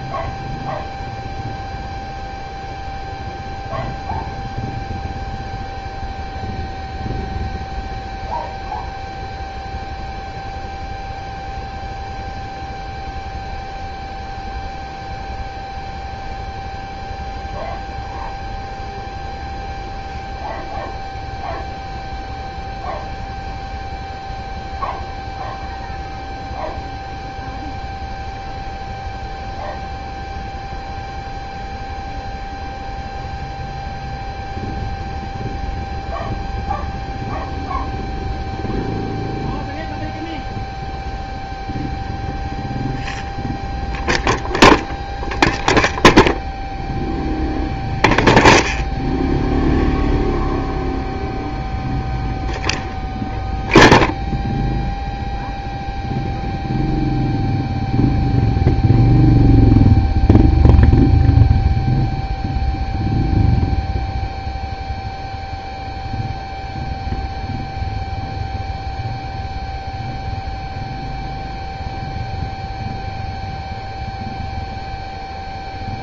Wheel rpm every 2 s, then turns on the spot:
0, 0, 0, 0, 0, 0, 0, 0, 0, 0, 0, 0, 0, 0, 0, 0, 0, 0, 0, 0, 0, 0, 0, 0, 0, 0, 0, 0, 0, 0, 0, 0, 0, 0, 0, 0, 0, 0.
none